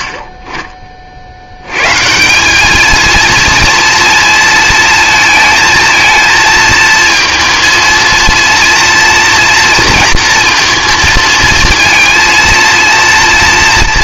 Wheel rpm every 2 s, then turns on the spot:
40, 200, 230, 230, 230, 230, 230.
none